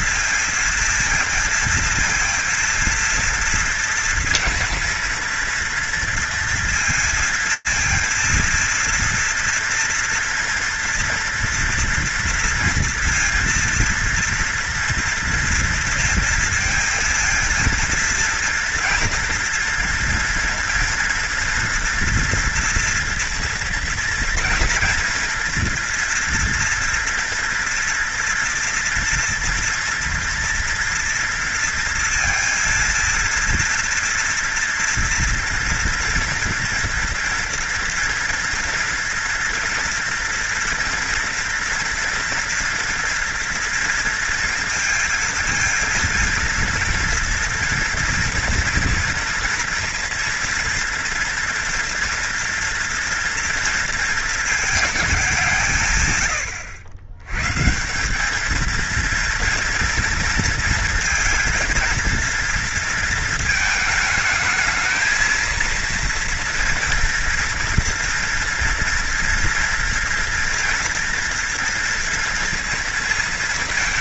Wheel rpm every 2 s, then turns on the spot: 230, 230, 230, 230, 230, 230, 230, 230, 230, 230, 230, 230, 230, 230, 240, 230, 230, 240, 230, 230, 230, 230, 230, 230, 240, 230, 240, 230, 100, 210, 230, 230, 220, 230, 240, 230, 230.
none